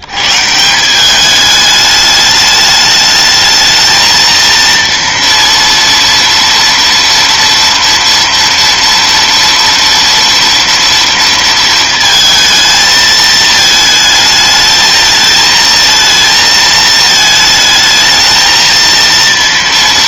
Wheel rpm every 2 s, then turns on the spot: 80, 210, 230, 230, 230, 230, 220, 220, 220, 220.
none